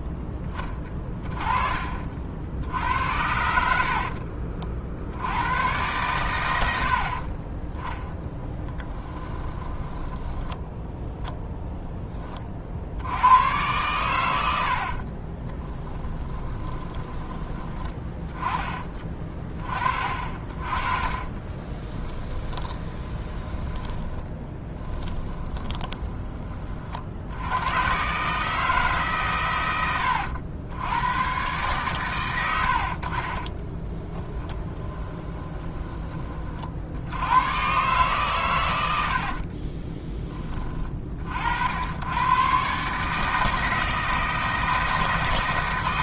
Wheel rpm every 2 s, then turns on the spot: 20, 70, 50, 80, 10, 10, 50, 60, 20, 30, 40, 10, 10, 40, 150, 100, 70, 10, 60, 90, 30, 130, 160.
0-2 8-12 14-18 22-26 34-36